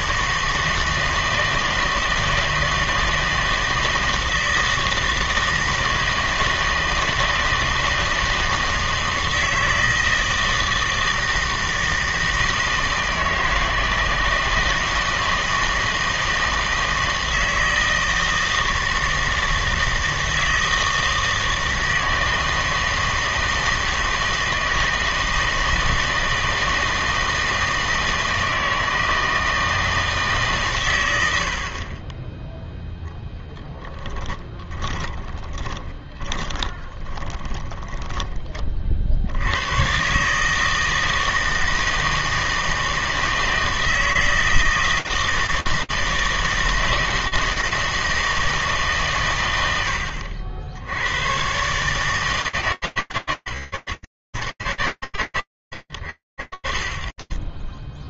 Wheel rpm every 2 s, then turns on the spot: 160, 160, 160, 160, 160, 160, 160, 160, 160, 160, 160, 160, 160, 160, 160, 140, 10, 20, 20, 30, 150, 160, 160, 160, 160, 80, 150, 80, 90.
34-38